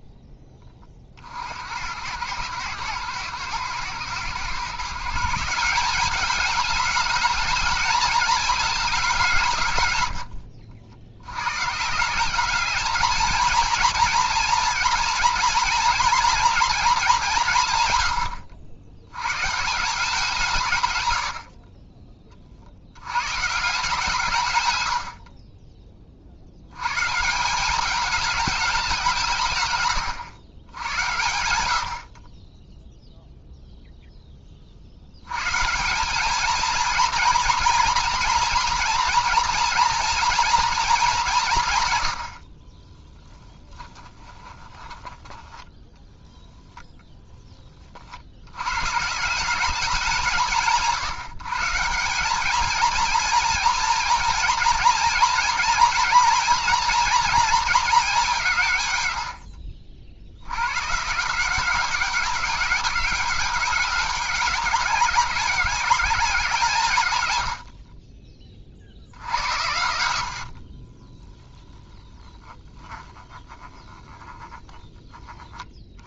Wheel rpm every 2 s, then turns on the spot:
20, 110, 140, 210, 220, 80, 210, 230, 220, 80, 140, 60, 120, 100, 210, 100, 10, 40, 230, 230, 230, 40, 10, 10, 110, 160, 220, 230, 230, 140, 110, 200, 200, 170, 40, 50, 10, 10.
42-46 70-72